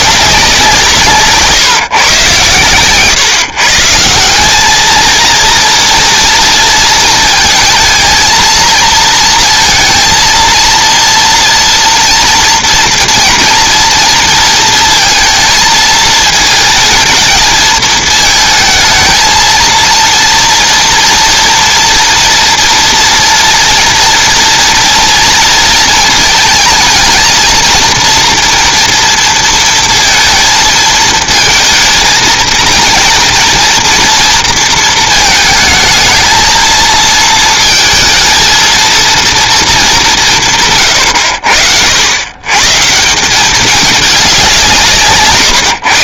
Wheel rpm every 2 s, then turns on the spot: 170, 130, 210, 230, 220, 230, 230, 230, 230, 220, 230, 230, 230, 230, 230, 230, 230, 230, 230, 220, 140, 140, 180.
none